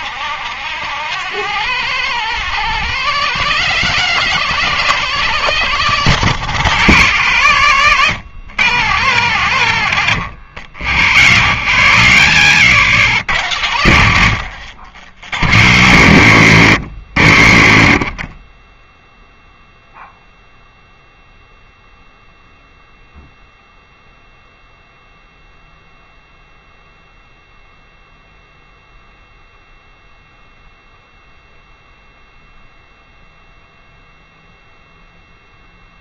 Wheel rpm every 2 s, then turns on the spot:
160, 170, 170, 150, 130, 70, 100, 70, 80, 10, 0, 0, 0, 0, 0, 0, 0, 0.
none